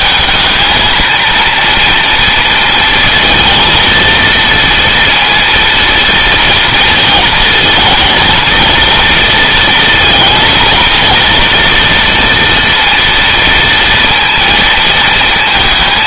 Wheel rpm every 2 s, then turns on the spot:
230, 230, 230, 230, 230, 220, 230, 230.
none